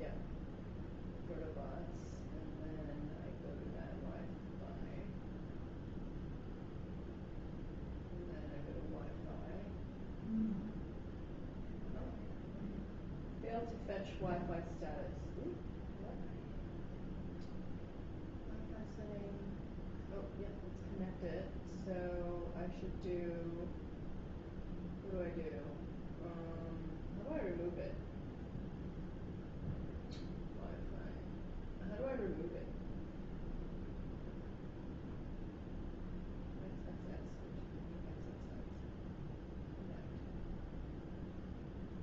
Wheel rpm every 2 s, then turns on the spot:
0, 0, 0, 0, 0, 0, 0, 0, 0, 0, 0, 0, 0, 0, 0, 0, 0, 0, 0, 0, 0.
none